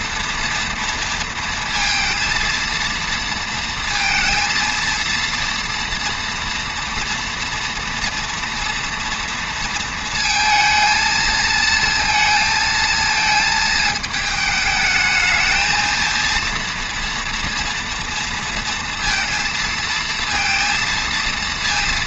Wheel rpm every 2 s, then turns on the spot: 230, 230, 230, 240, 230, 220, 230, 220, 230, 230, 230.
none